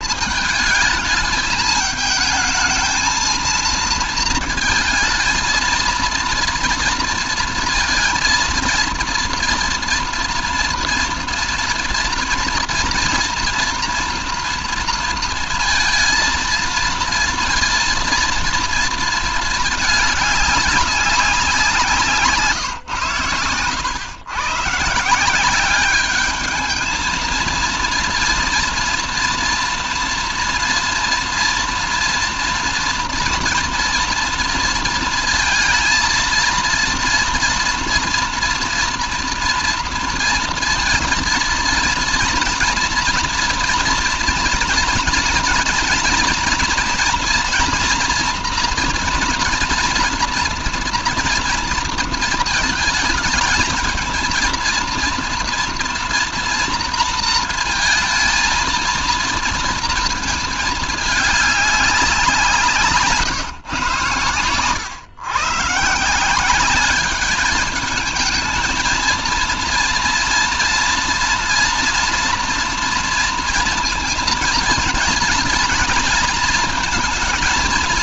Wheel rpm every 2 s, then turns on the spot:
220, 220, 220, 230, 230, 230, 240, 230, 230, 230, 200, 120, 150, 220, 230, 230, 230, 230, 230, 240, 230, 230, 240, 230, 230, 230, 220, 230, 230, 230, 210, 160, 120, 200, 220, 230, 230, 230, 230.
none